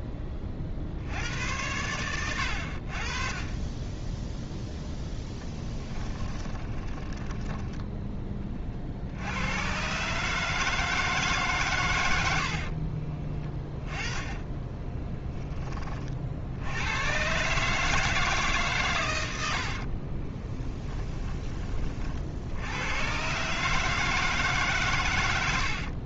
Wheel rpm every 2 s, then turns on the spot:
60, 60, 0, 20, 50, 160, 40, 10, 100, 120, 20, 100, 140.
6-8 12-16